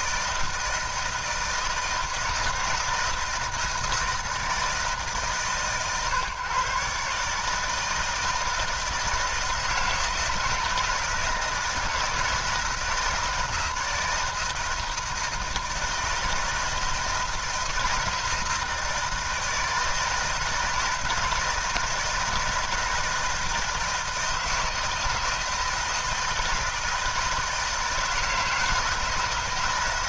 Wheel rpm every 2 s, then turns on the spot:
160, 160, 150, 130, 160, 160, 160, 160, 160, 160, 160, 160, 160, 160, 160.
none